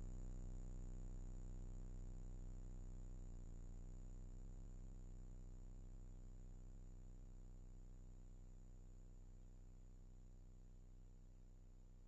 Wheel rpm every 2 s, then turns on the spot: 20, 40, 30, 40, 30, 20.
none